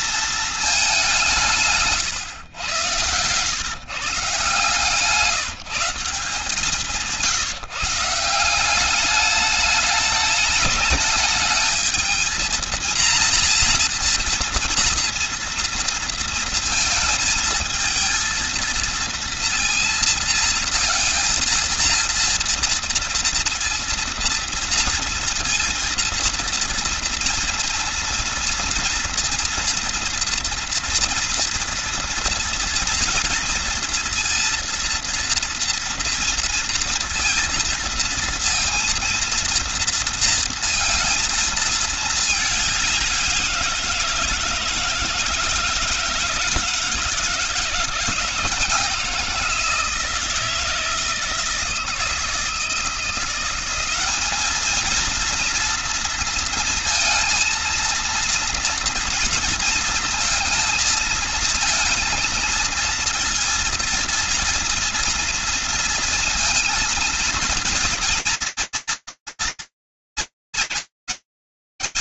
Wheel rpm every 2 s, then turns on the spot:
190, 110, 160, 170, 200, 210, 230, 230, 230, 230, 230, 230, 230, 230, 230, 230, 230, 230, 230, 230, 230, 190, 160, 160, 170, 160, 170, 230, 230, 230, 230, 230, 230, 230, 230, 210.
none